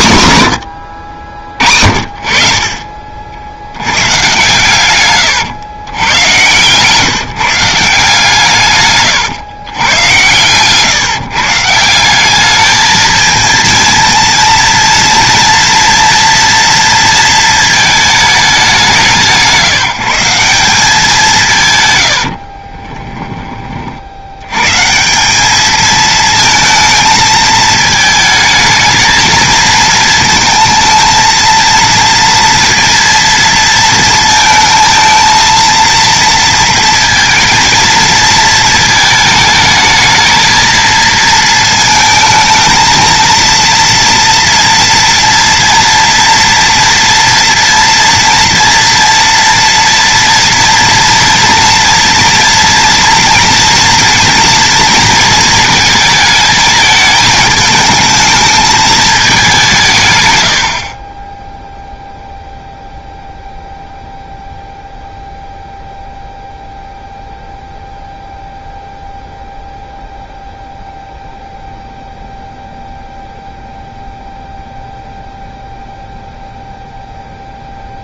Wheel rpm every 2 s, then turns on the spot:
70, 50, 110, 150, 120, 140, 220, 230, 230, 160, 180, 20, 170, 220, 220, 220, 230, 220, 230, 220, 220, 220, 230, 230, 230, 230, 230, 230, 210, 210, 30, 0, 0, 0, 0, 0, 0, 0, 0.
8-10 22-24